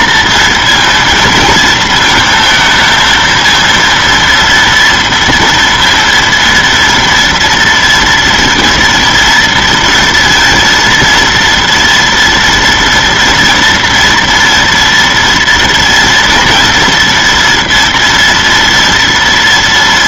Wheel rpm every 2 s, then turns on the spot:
230, 230, 230, 230, 230, 230, 230, 240, 230, 230.
none